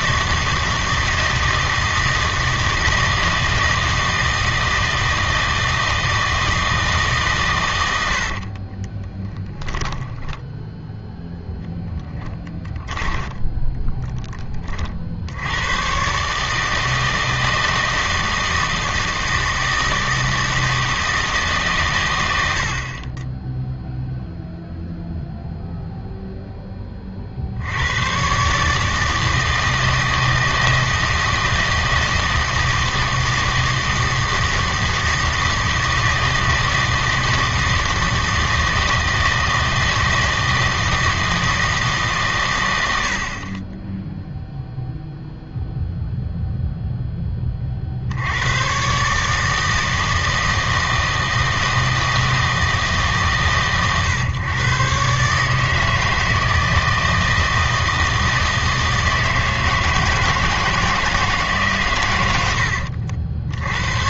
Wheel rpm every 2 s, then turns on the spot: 160, 160, 160, 160, 40, 10, 10, 30, 150, 160, 160, 70, 0, 10, 140, 160, 160, 160, 160, 160, 160, 100, 0, 0, 110, 160, 160, 120, 160, 160, 160, 70.
8-10 12-14 62-64